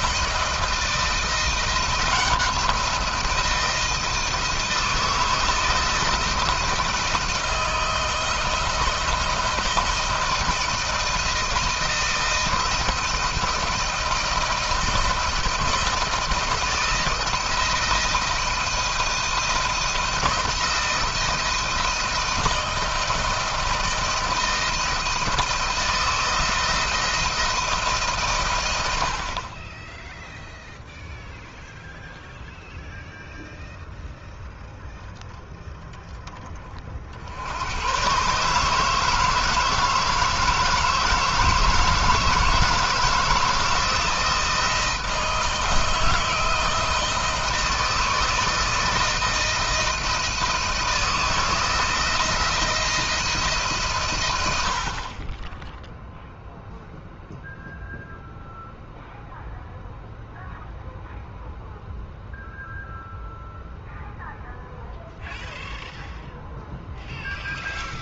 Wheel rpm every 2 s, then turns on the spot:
160, 170, 160, 170, 160, 170, 160, 160, 160, 160, 160, 160, 170, 160, 100, 0, 0, 0, 30, 150, 160, 160, 160, 160, 160, 160, 160, 70, 0, 0, 0, 0, 0, 0.
none